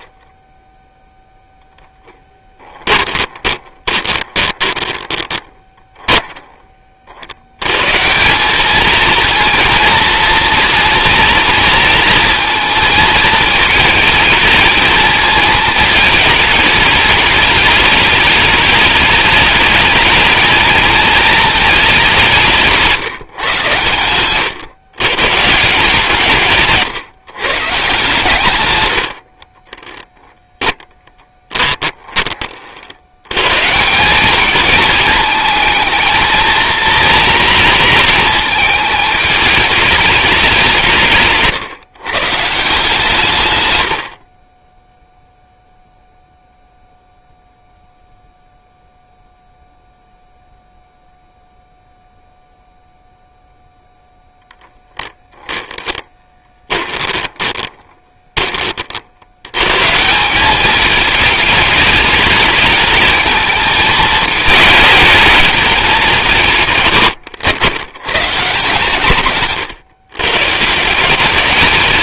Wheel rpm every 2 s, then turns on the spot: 0, 20, 20, 50, 220, 240, 220, 220, 210, 210, 220, 180, 130, 140, 120, 10, 80, 220, 230, 220, 170, 150, 10, 0, 0, 0, 0, 10, 20, 30, 210, 210, 220, 150, 150, 160.
2-6 30-32 44-46 54-58